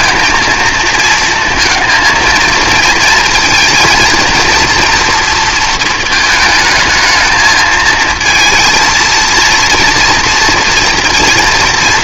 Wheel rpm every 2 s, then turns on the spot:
230, 230, 230, 220, 230, 240.
none